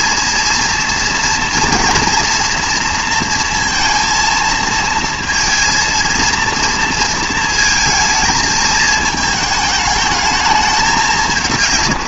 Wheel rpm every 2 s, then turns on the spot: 230, 230, 220, 230, 220, 200.
none